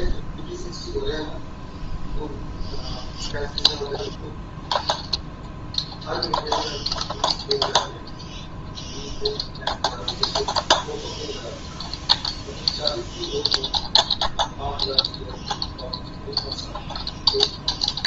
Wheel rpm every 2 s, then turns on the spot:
0, 0, 0, 0, 0, 0, 0, 0, 0.
none